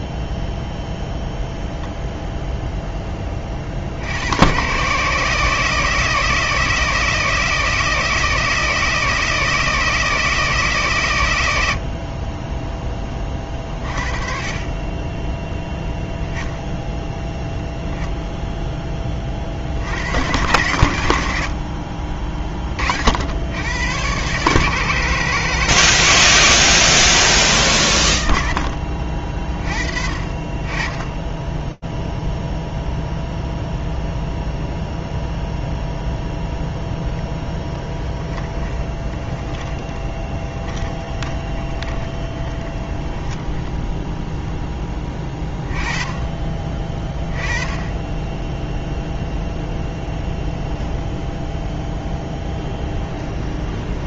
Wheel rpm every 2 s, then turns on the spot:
0, 10, 130, 160, 160, 120, 20, 20, 0, 20, 110, 60, 150, 100, 50, 20, 0, 0, 0, 10, 20, 10, 10, 20, 0, 0, 20.
38-44 52-54